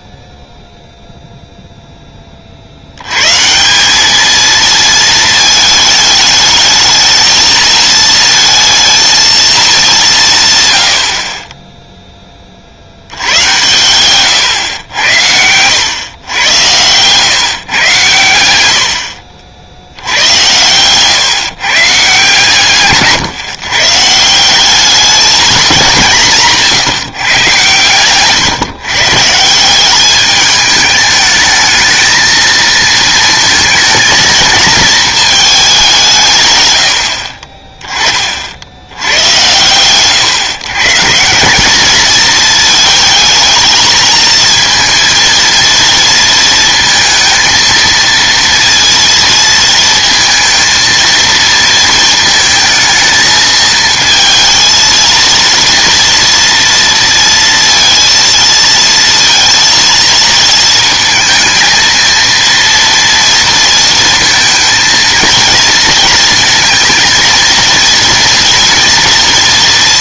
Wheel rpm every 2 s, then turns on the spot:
0, 140, 220, 220, 220, 30, 100, 90, 130, 60, 130, 140, 210, 120, 160, 210, 220, 210, 30, 100, 160, 220, 230, 220, 230, 230, 220, 230, 230, 230, 220, 230, 230, 230, 240.
none